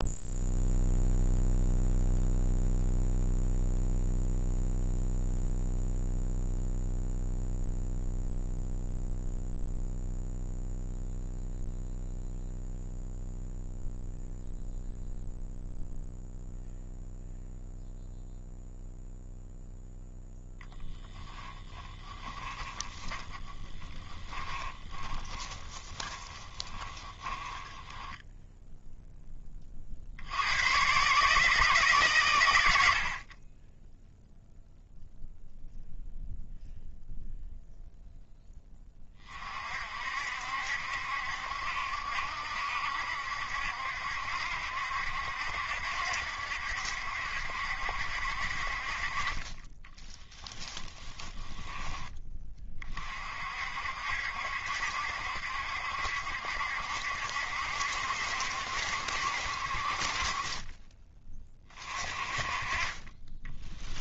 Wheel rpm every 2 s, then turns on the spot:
0, 0, 0, 0, 0, 0, 0, 0, 0, 0, 10, 20, 20, 20, 0, 100, 90, 0, 0, 20, 70, 70, 70, 70, 50, 10, 30, 70, 70, 70, 30, 30.
22-28 50-52